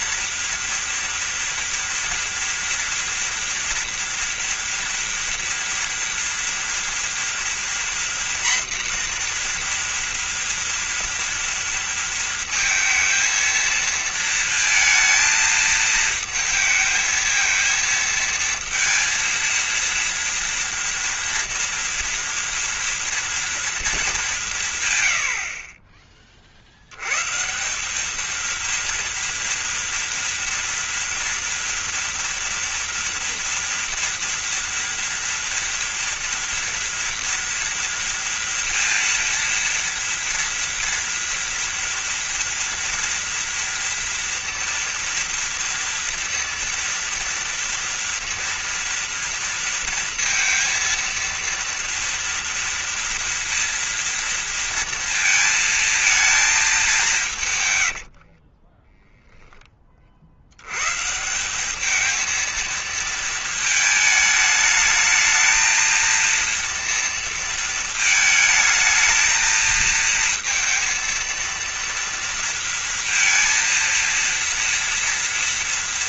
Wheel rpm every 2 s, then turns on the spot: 230, 230, 230, 230, 250, 230, 230, 220, 220, 230, 240, 240, 100, 100, 230, 230, 230, 230, 230, 230, 230, 230, 230, 230, 230, 230, 230, 230, 200, 10, 150, 220, 220, 230, 220, 230, 230, 230.
58-60